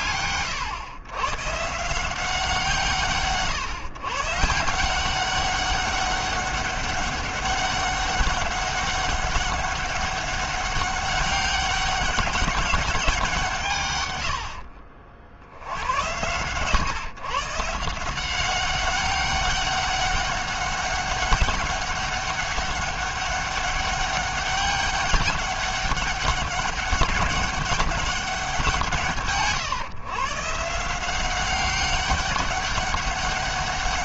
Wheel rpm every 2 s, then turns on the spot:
120, 170, 170, 200, 200, 200, 190, 60, 120, 190, 200, 200, 200, 200, 180, 160, 200.
14-16